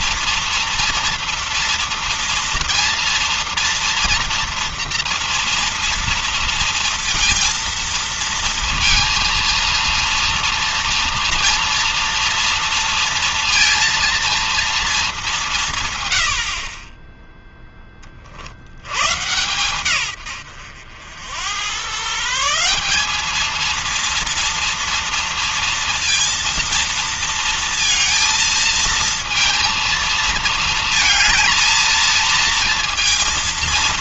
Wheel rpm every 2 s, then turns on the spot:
230, 230, 230, 230, 230, 230, 230, 230, 50, 60, 100, 150, 230, 230, 230, 230, 230.
none